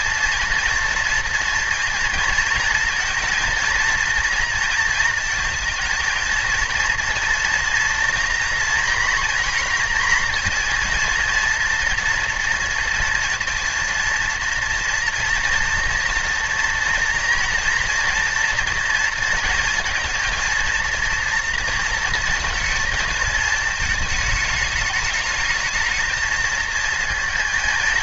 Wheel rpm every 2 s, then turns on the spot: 230, 230, 230, 230, 230, 230, 220, 230, 230, 230, 230, 220, 220, 230.
none